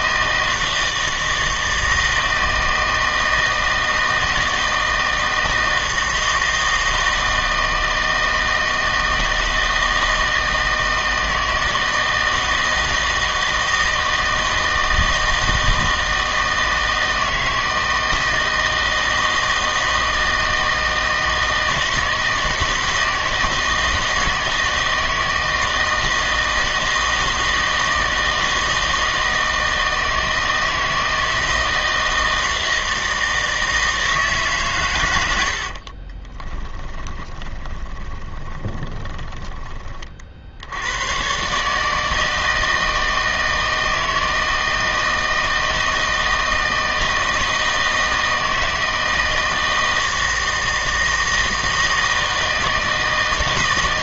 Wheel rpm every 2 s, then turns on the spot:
160, 160, 160, 160, 160, 160, 160, 160, 160, 160, 160, 160, 160, 160, 160, 160, 160, 130, 10, 20, 80, 160, 160, 160, 160, 160, 160.
36-40